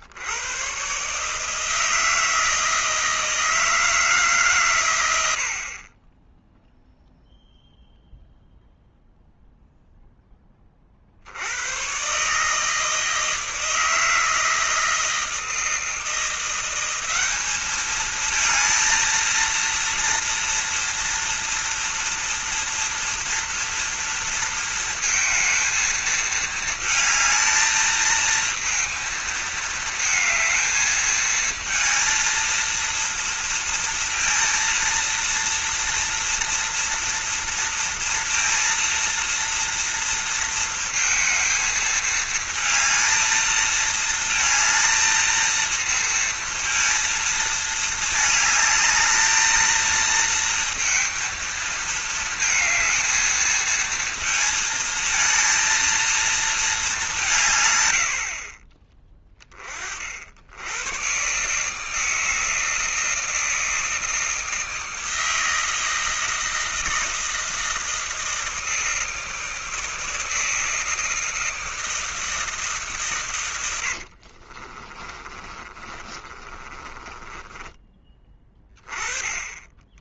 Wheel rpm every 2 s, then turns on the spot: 110, 160, 130, 0, 0, 30, 160, 160, 180, 220, 230, 230, 230, 220, 230, 220, 230, 230, 240, 230, 220, 230, 230, 230, 220, 230, 230, 230, 220, 40, 90, 160, 160, 160, 160, 160, 150, 40, 30, 30.
74-78